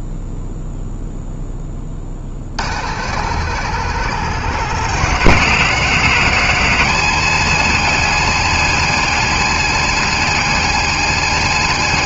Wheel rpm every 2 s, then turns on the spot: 0, 120, 160, 150, 130, 130.
none